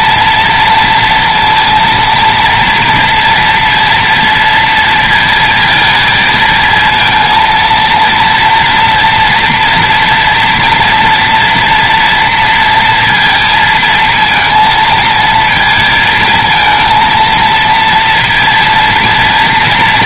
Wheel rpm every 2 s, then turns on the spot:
230, 230, 230, 230, 230, 230, 230, 220, 220, 230.
none